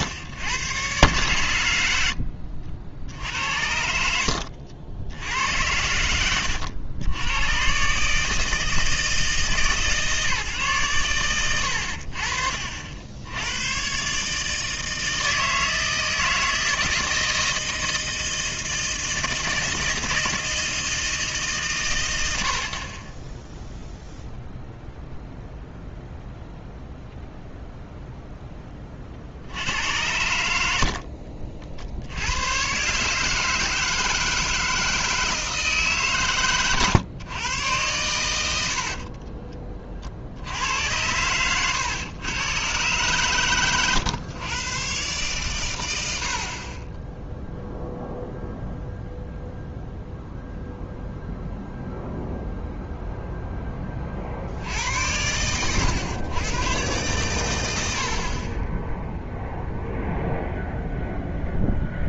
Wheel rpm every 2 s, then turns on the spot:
70, 20, 90, 80, 120, 150, 60, 140, 160, 160, 160, 70, 0, 0, 20, 70, 130, 160, 120, 70, 80, 120, 120, 30, 0, 0, 0, 80, 120, 40, 0.
58-60